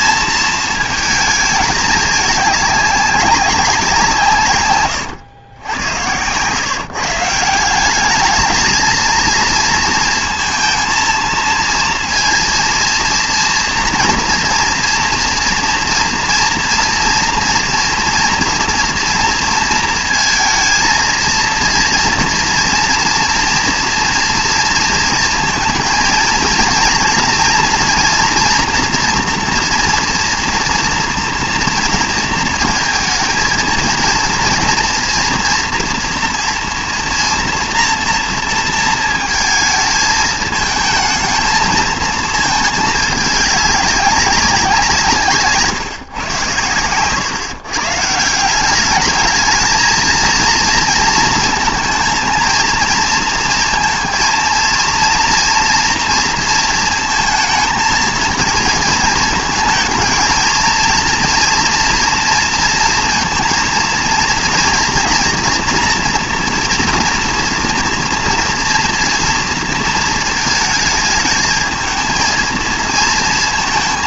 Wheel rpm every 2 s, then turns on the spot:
220, 200, 120, 130, 220, 230, 230, 240, 240, 230, 230, 230, 230, 230, 240, 230, 220, 230, 230, 230, 220, 220, 190, 120, 190, 230, 230, 230, 230, 230, 230, 230, 230, 240, 230, 220, 230.
none